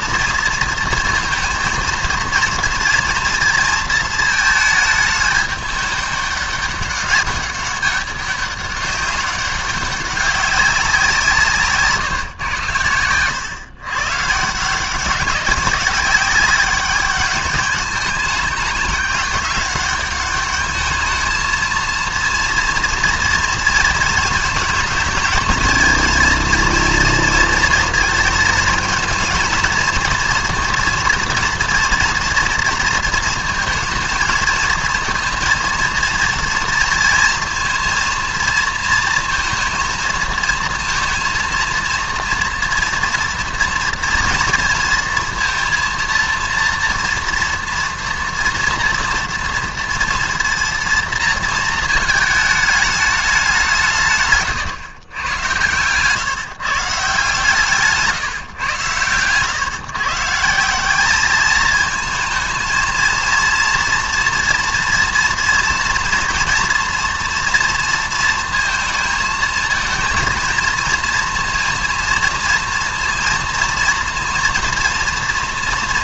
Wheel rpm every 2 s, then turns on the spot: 230, 230, 220, 200, 200, 190, 110, 160, 210, 210, 210, 230, 220, 230, 220, 230, 230, 230, 240, 230, 230, 230, 230, 230, 230, 230, 220, 140, 160, 140, 170, 220, 230, 230, 230, 230, 230, 230.
none